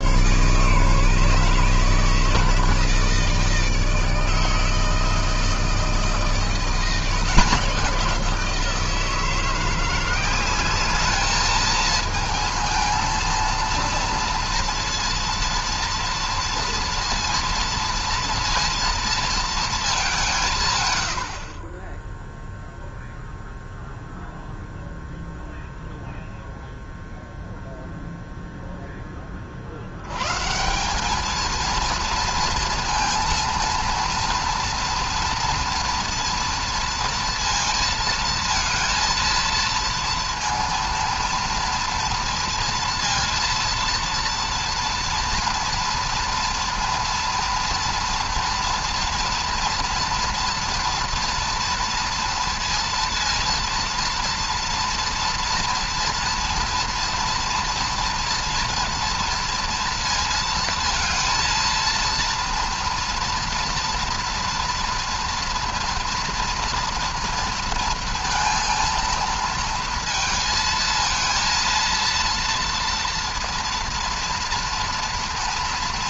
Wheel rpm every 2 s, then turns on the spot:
140, 150, 160, 170, 170, 200, 220, 230, 230, 230, 110, 0, 0, 0, 10, 200, 230, 230, 230, 220, 230, 230, 230, 230, 230, 230, 230, 230, 230, 230, 230, 230, 230, 230, 230, 220, 230, 230.
none